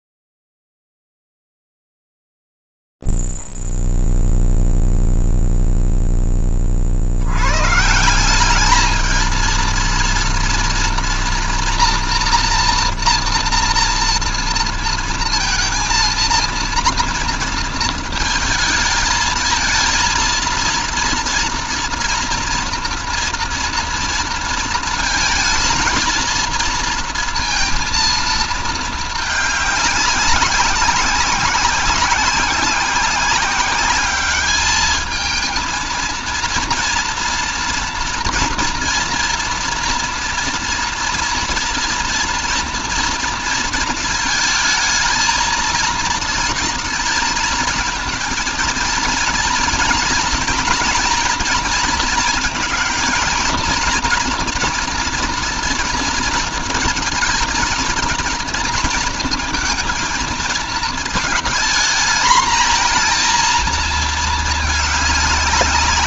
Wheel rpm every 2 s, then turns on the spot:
0, 0, 0, 0, 150, 230, 240, 230, 230, 230, 230, 230, 230, 230, 230, 190, 190, 200, 230, 230, 230, 230, 230, 230, 230, 230, 230, 240, 220, 230, 220, 220, 220.
none